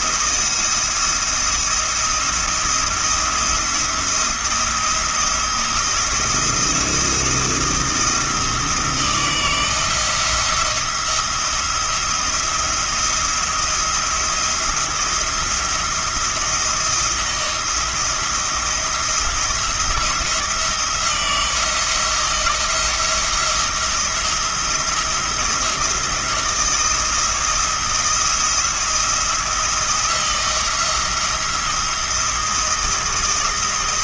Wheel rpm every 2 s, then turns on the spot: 170, 170, 160, 170, 170, 170, 170, 170, 170, 170, 160, 170, 170, 170, 170, 170, 160.
none